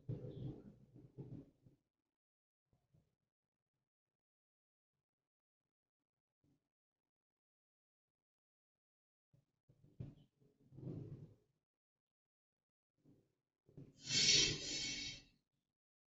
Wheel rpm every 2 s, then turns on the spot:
0, 0, 0, 0, 0, 0, 0, 0.
none